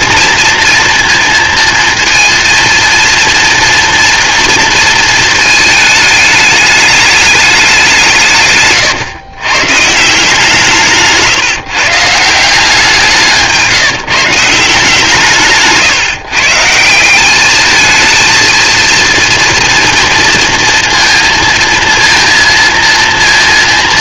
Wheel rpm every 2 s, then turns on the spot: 230, 230, 230, 210, 130, 160, 170, 160, 150, 230, 230, 230.
none